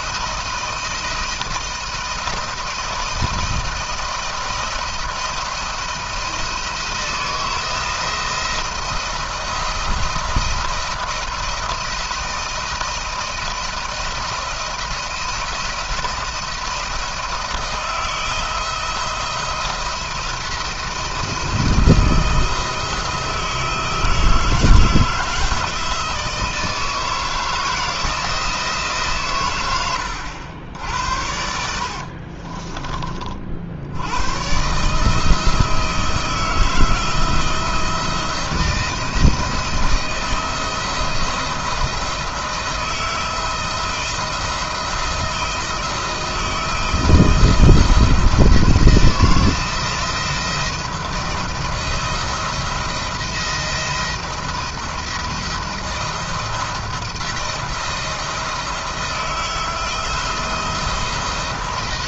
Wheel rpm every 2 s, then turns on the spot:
160, 170, 170, 160, 170, 170, 170, 170, 170, 170, 170, 170, 160, 160, 150, 80, 40, 140, 170, 160, 160, 170, 160, 160, 170, 170, 170, 170, 170, 170, 170.
none